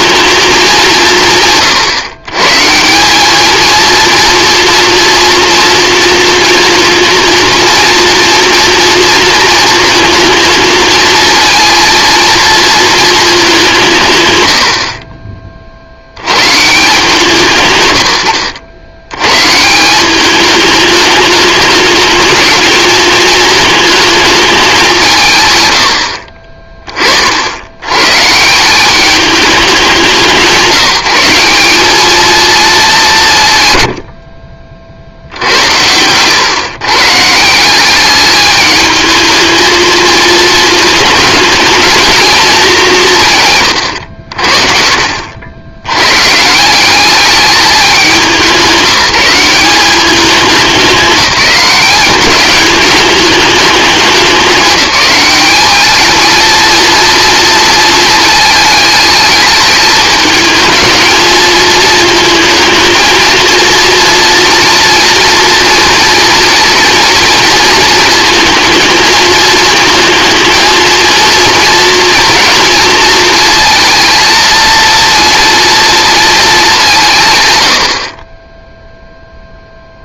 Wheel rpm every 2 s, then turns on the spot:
190, 150, 230, 230, 230, 230, 230, 80, 150, 90, 210, 220, 200, 30, 170, 190, 220, 60, 130, 210, 220, 210, 50, 180, 180, 200, 210, 200, 230, 220, 220, 220, 230, 230, 220, 230, 230, 230, 200, 0.
34-36 44-46